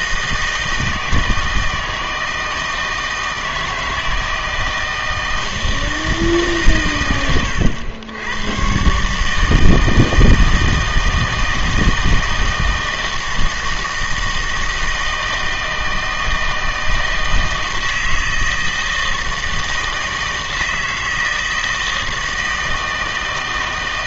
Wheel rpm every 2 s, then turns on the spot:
160, 160, 160, 140, 120, 160, 160, 160, 160, 160, 160, 160.
none